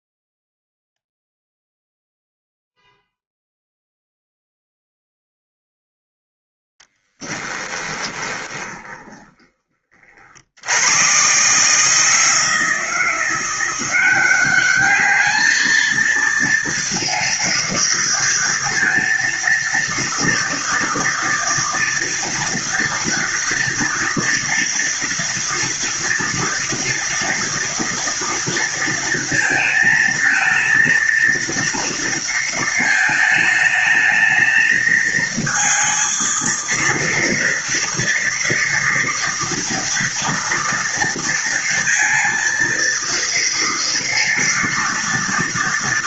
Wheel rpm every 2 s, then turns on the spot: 0, 0, 0, 10, 20, 110, 170, 210, 230, 230, 230, 230, 230, 230, 230, 230, 220, 220, 230, 240, 230, 230, 240.
6-10